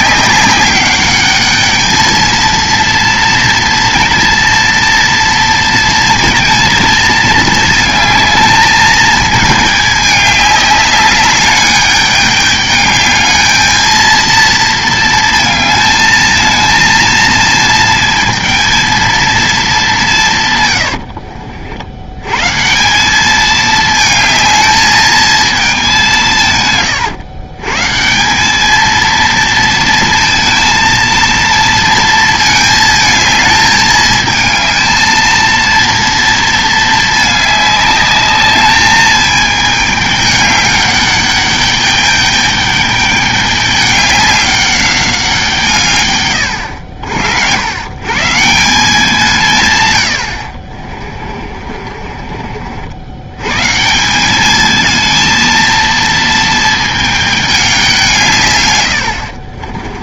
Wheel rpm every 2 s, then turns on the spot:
200, 230, 230, 220, 220, 210, 210, 230, 220, 230, 130, 140, 220, 140, 200, 230, 220, 220, 230, 210, 210, 210, 200, 90, 170, 60, 50, 210, 220, 130.
20-22 50-52